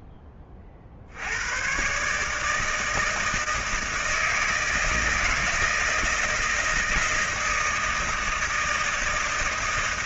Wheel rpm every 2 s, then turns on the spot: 30, 150, 160, 160, 160.
none